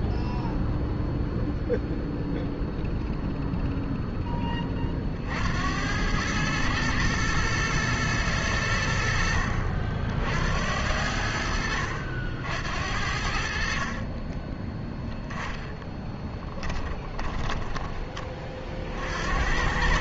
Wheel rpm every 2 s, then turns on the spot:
0, 0, 30, 110, 80, 90, 70, 10, 10, 50.
14-18